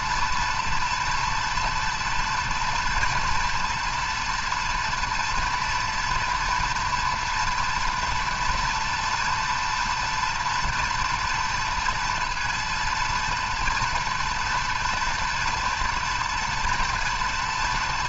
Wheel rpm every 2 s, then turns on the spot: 230, 230, 230, 240, 230, 230, 230, 230, 240.
none